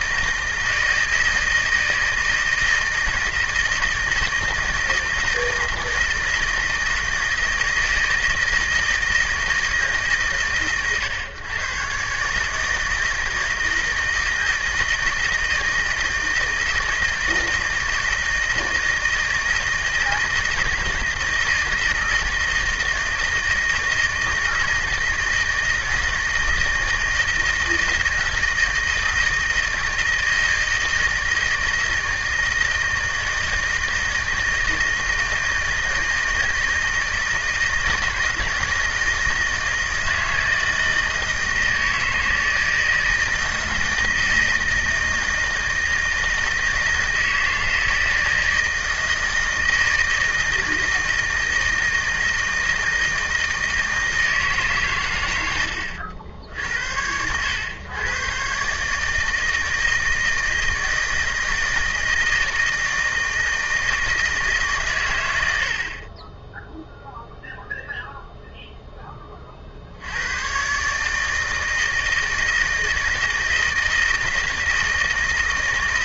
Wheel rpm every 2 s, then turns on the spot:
160, 160, 160, 160, 160, 110, 160, 160, 160, 160, 160, 160, 160, 160, 160, 160, 160, 160, 160, 160, 160, 160, 160, 160, 160, 160, 160, 120, 90, 140, 160, 160, 130, 0, 0, 140, 160, 160.
none